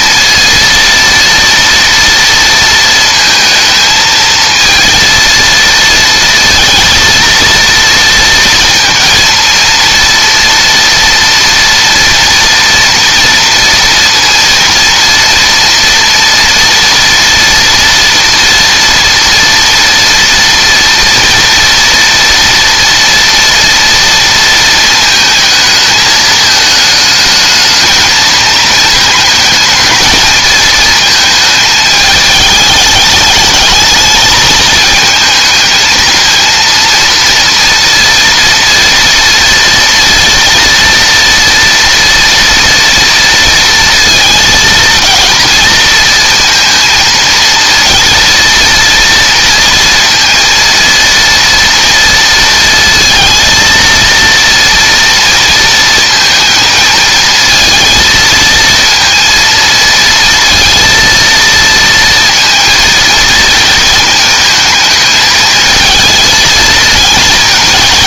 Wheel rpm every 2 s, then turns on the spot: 230, 230, 230, 230, 230, 230, 230, 230, 230, 230, 230, 230, 230, 220, 220, 220, 210, 220, 230, 230, 230, 230, 230, 230, 240, 230, 230, 230, 230, 230, 230, 230, 220, 220.
none